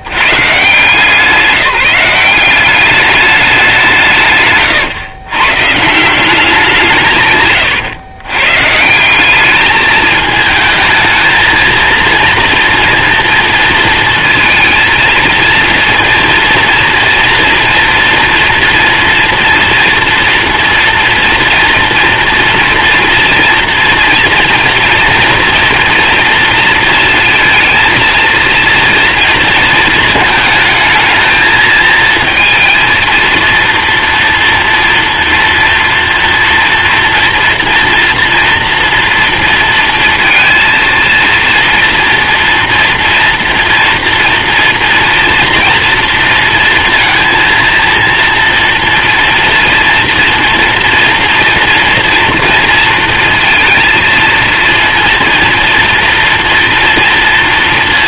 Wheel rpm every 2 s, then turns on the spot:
130, 200, 140, 170, 140, 220, 230, 220, 230, 230, 230, 230, 240, 230, 230, 220, 230, 230, 230, 240, 230, 230, 230, 230, 230, 230, 230, 230, 230.
none